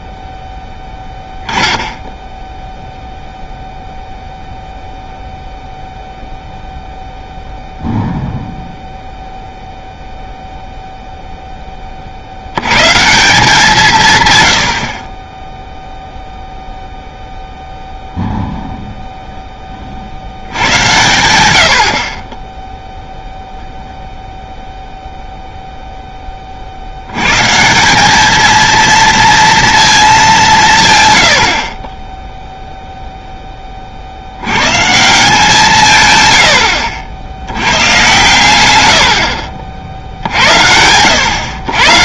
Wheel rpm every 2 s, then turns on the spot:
10, 0, 0, 0, 0, 0, 110, 70, 0, 0, 90, 0, 0, 50, 230, 170, 0, 140, 80, 110, 80.
none